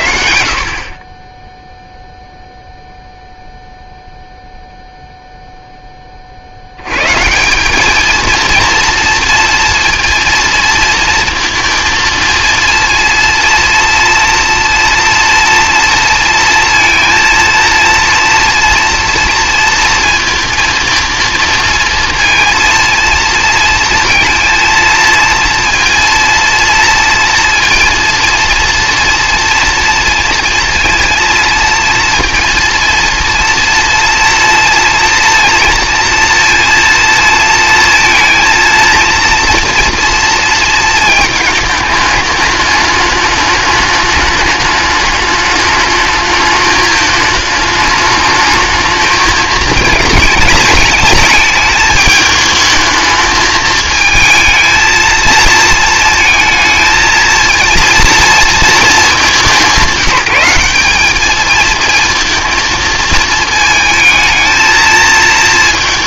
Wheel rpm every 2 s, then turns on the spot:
110, 0, 0, 90, 230, 230, 230, 230, 230, 230, 230, 230, 230, 230, 230, 230, 230, 230, 230, 230, 230, 210, 210, 210, 220, 210, 220, 220, 220, 220, 200, 230, 220.
none